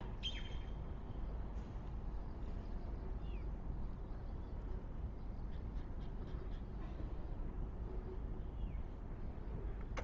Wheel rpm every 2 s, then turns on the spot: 0, 0, 0, 0, 0.
none